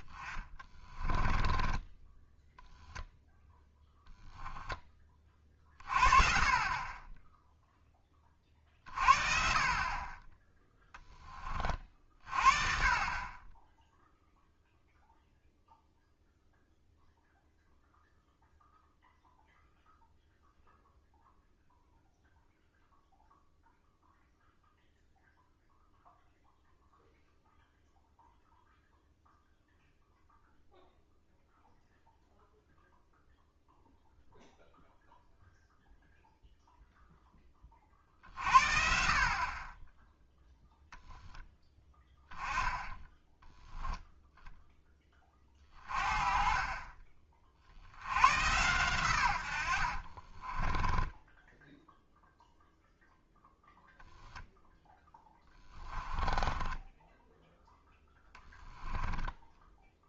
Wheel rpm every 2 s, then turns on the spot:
20, 0, 10, 30, 40, 10, 40, 0, 0, 0, 0, 0, 0, 0, 0, 0, 0, 0, 0, 50, 10, 10, 10, 30, 110, 20, 0, 0, 10, 10.
50-52 56-60